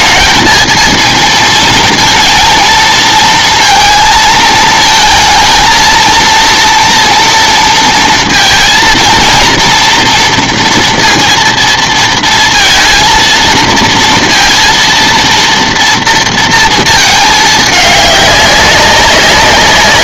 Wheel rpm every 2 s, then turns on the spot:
220, 230, 220, 230, 230, 230, 230, 230, 230, 190.
none